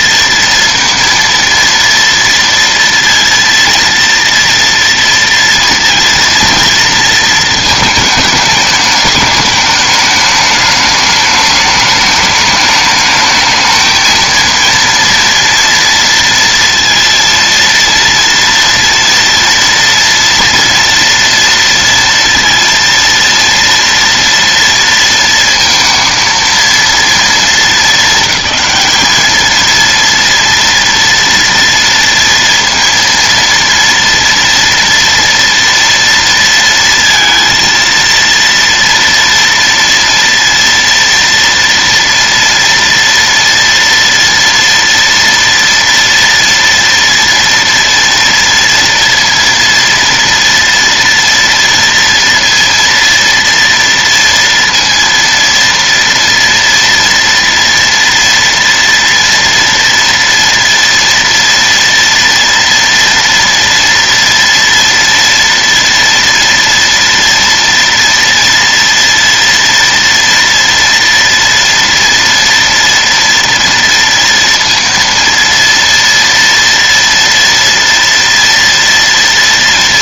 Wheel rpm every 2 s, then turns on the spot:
230, 230, 230, 230, 220, 210, 210, 230, 230, 230, 230, 230, 230, 230, 210, 240, 230, 230, 230, 230, 230, 240, 230, 230, 230, 230, 230, 230, 230, 230, 230, 230, 230, 230, 230, 230, 230, 230, 230, 230.
none